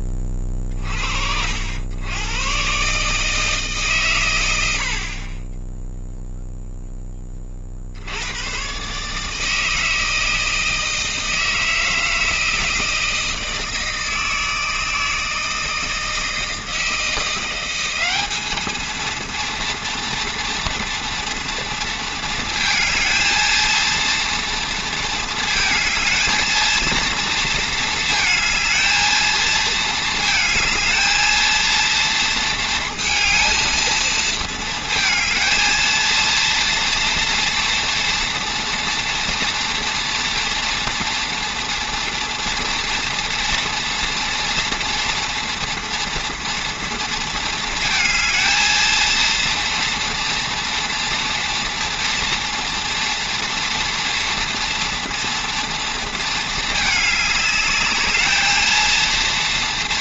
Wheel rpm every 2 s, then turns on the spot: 60, 140, 60, 10, 140, 160, 160, 160, 160, 220, 230, 220, 230, 230, 220, 220, 230, 220, 230, 240, 230, 230, 230, 230, 230, 230, 240, 240, 210, 230.
none